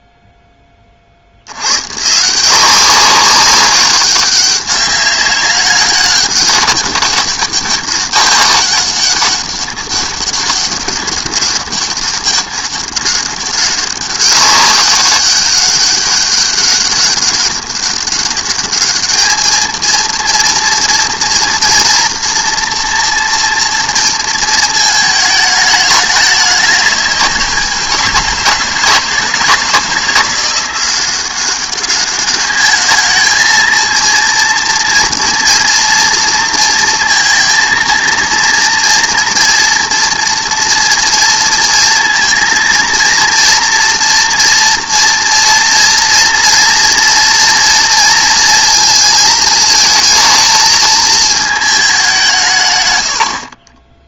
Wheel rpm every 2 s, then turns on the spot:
20, 180, 200, 200, 200, 200, 200, 200, 200, 210, 230, 240, 220, 190, 160, 180, 210, 230, 230, 230, 230, 230, 230, 230, 230, 230, 120.
none